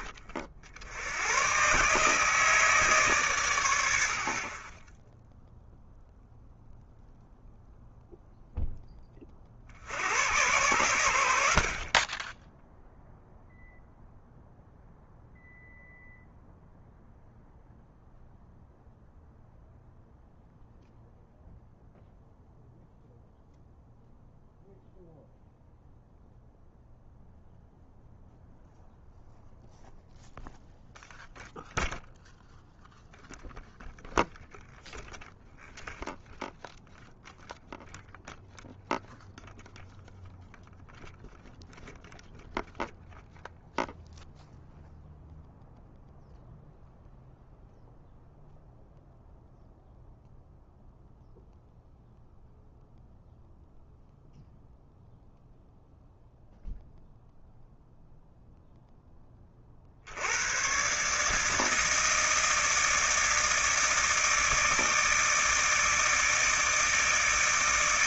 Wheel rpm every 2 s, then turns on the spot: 80, 150, 20, 0, 20, 90, 0, 0, 0, 0, 0, 0, 0, 0, 0, 0, 0, 0, 0, 0, 0, 0, 0, 0, 0, 0, 0, 0, 0, 10, 140, 160, 160, 150.
4-6